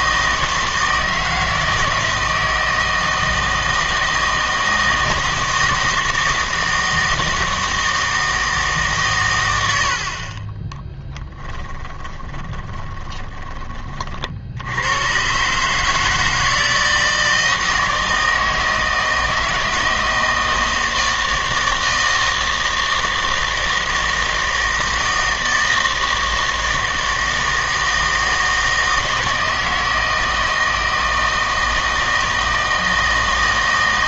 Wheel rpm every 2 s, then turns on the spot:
160, 160, 160, 160, 150, 20, 20, 80, 160, 160, 160, 160, 160, 160, 160, 160, 160.
10-14